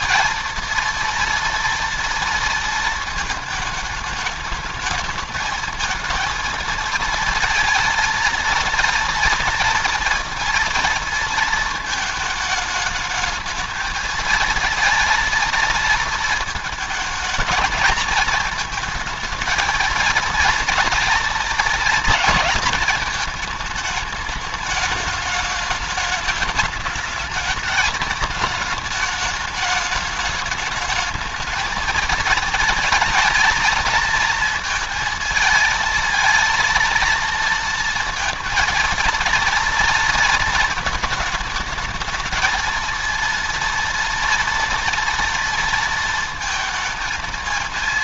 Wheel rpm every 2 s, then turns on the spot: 230, 230, 210, 230, 230, 230, 210, 230, 220, 230, 230, 220, 210, 210, 210, 210, 220, 230, 230, 230, 220, 230, 230, 230.
none